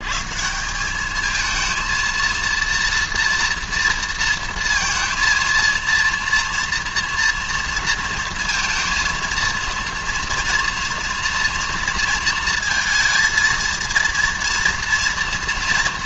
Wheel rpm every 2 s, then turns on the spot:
170, 230, 230, 230, 230, 230, 230, 230.
none